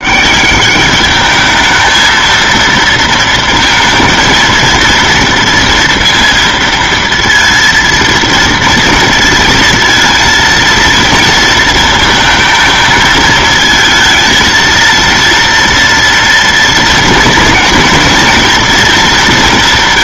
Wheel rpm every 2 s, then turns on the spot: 200, 230, 230, 230, 230, 230, 220, 230, 240, 230.
none